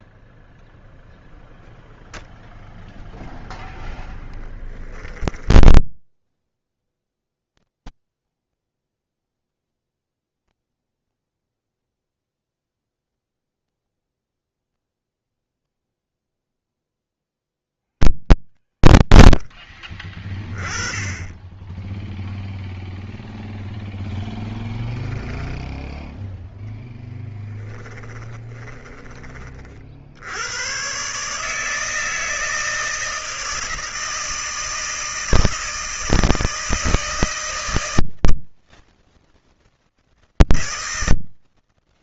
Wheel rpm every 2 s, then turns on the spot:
0, 0, 20, 30, 20, 20, 10, 20, 20, 40, 20, 0, 10, 0, 20, 110, 160, 160, 160, 160, 160.
4-18 28-30